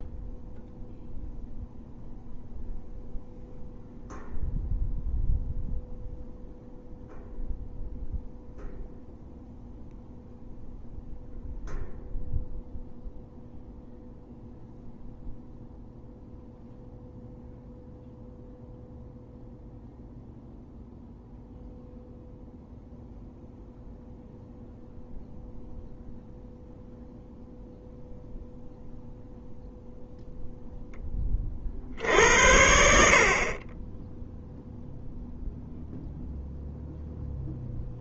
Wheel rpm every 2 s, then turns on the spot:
0, 0, 0, 0, 0, 0, 0, 0, 0, 0, 0, 0, 0, 0, 0, 10, 60, 0, 0.
none